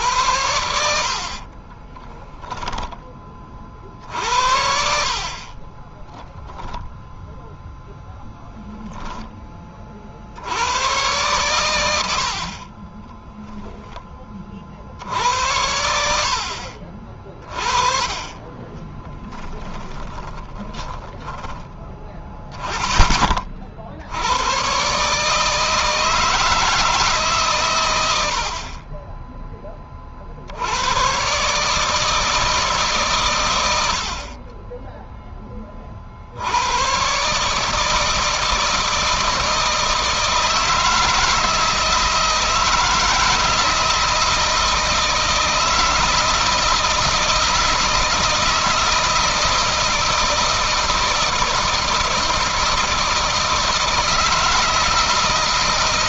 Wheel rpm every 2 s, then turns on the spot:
80, 20, 60, 0, 10, 100, 30, 50, 50, 10, 30, 10, 130, 150, 30, 100, 140, 20, 110, 160, 160, 160, 160, 160, 160, 160, 160, 160.
0-2 12-14 18-22